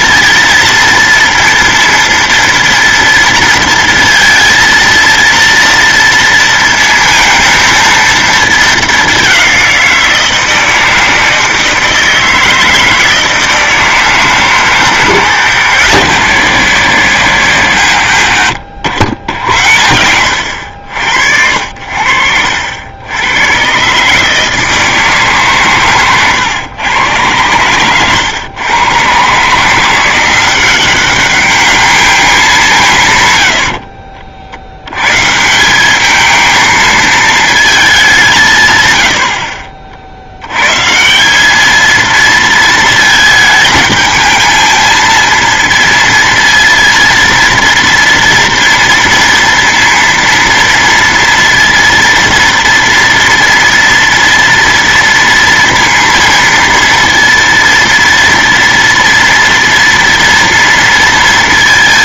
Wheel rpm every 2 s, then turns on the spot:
230, 230, 230, 230, 220, 170, 160, 150, 150, 100, 100, 70, 150, 120, 110, 170, 210, 60, 220, 190, 70, 230, 220, 230, 230, 230, 230, 230, 230, 230, 230.
18-20 26-28